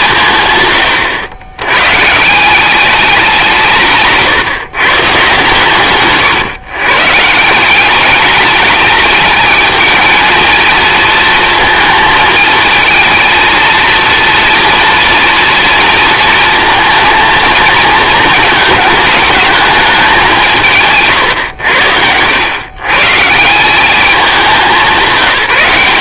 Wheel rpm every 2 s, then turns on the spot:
130, 190, 130, 130, 210, 220, 230, 240, 230, 220, 160, 120, 200.
none